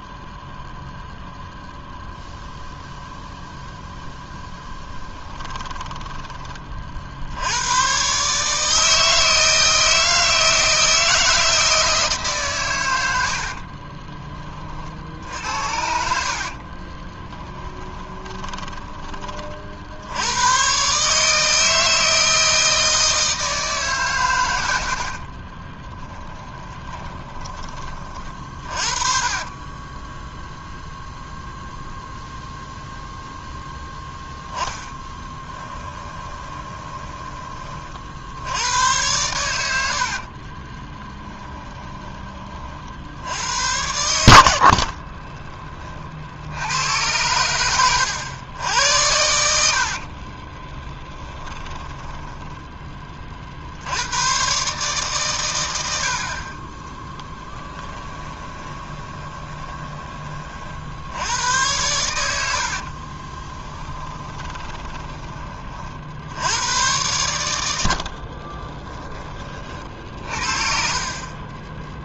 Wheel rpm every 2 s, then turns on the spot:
0, 0, 10, 20, 150, 160, 120, 50, 40, 10, 120, 160, 80, 20, 40, 0, 0, 10, 20, 90, 30, 50, 60, 90, 100, 20, 10, 130, 30, 20, 60, 70, 20, 100, 20, 50.
4-6 16-20 24-30 34-38 40-42 44-46 50-52 56-60 62-66 68-72